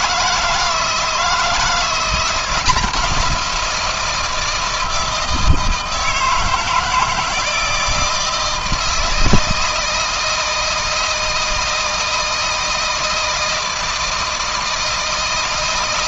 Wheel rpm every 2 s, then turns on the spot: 160, 170, 160, 160, 160, 160, 160, 160.
none